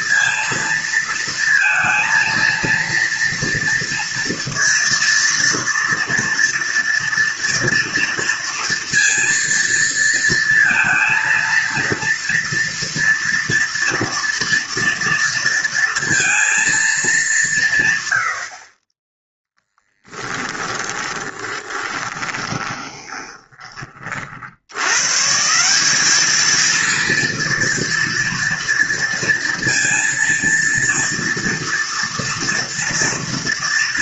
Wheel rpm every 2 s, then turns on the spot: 230, 230, 230, 230, 230, 230, 230, 230, 210, 10, 20, 20, 120, 230, 230, 240, 230.
20-24